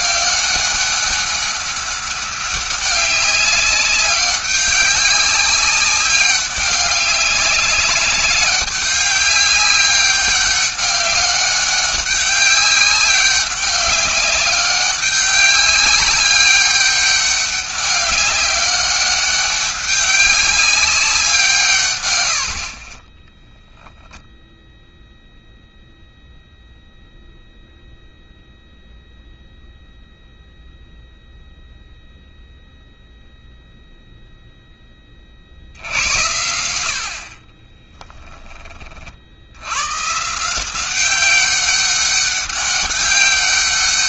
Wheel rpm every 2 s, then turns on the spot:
200, 200, 200, 190, 200, 200, 200, 190, 200, 200, 190, 50, 0, 0, 0, 0, 0, 10, 80, 30, 180, 200.
none